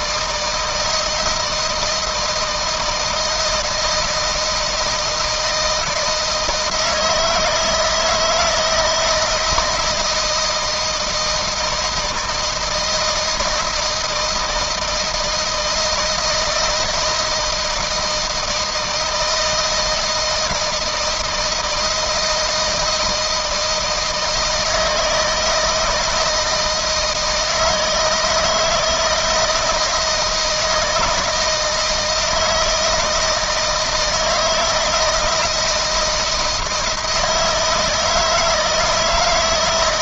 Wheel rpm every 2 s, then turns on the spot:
160, 160, 160, 160, 160, 160, 160, 160, 160, 160, 160, 160, 160, 160, 160, 160, 160, 160, 170, 160.
none